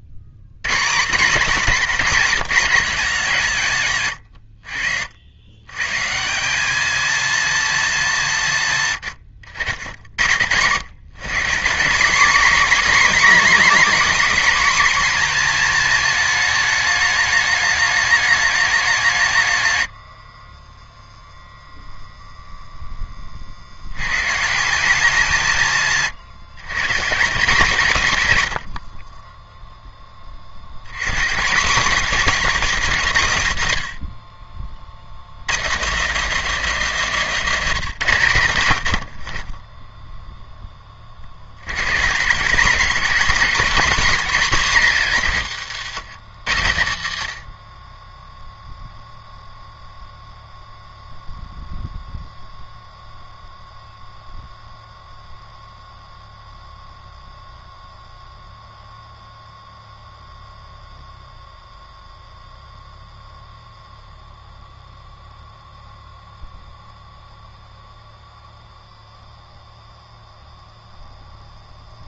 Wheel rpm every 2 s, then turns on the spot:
30, 200, 70, 200, 150, 140, 260, 250, 220, 200, 20, 0, 180, 150, 80, 100, 240, 60, 240, 90, 10, 190, 230, 120, 0, 0, 0, 0, 0, 0, 0, 0, 0, 0, 0, 0.
none